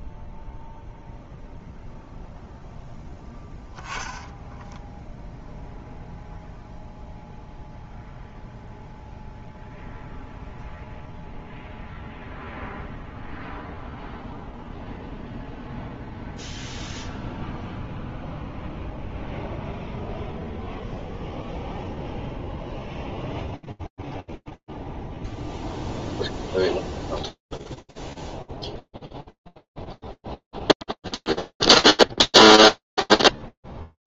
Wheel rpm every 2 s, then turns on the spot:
0, 0, 0, 0, 0, 0, 0, 0, 0, 0, 0, 0, 0, 0, 0, 0, 0.
none